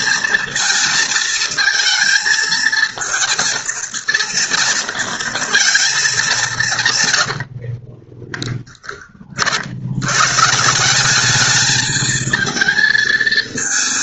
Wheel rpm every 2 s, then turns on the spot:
220, 230, 230, 60, 30, 210, 230.
6-8